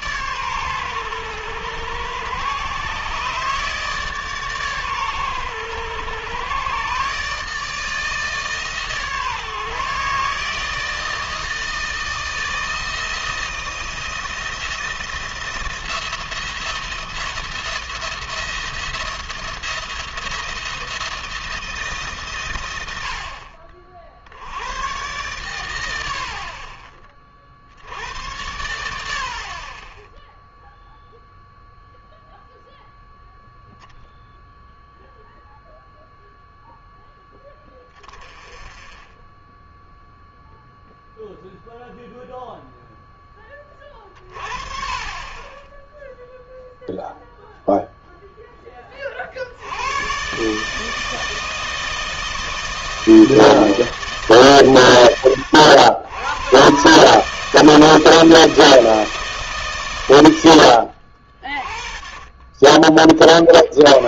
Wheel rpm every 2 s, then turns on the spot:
110, 140, 130, 140, 150, 160, 160, 170, 170, 170, 170, 60, 120, 50, 90, 0, 0, 0, 10, 10, 0, 10, 30, 0, 40, 160, 160, 110, 140, 160, 60, 30.
none